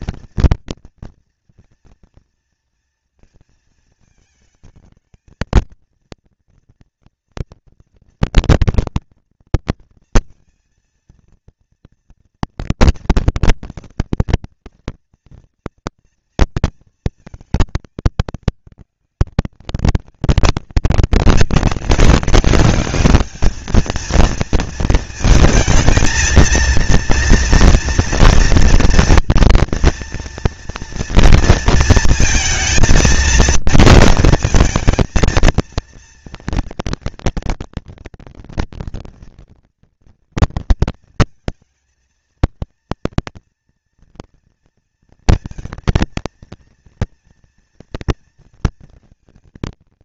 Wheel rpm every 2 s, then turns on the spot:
230, 230, 220, 230, 230, 230, 230, 230, 230, 210, 190, 200, 220, 230, 230, 230, 220, 220, 230, 240, 230, 230, 230, 230, 230.
none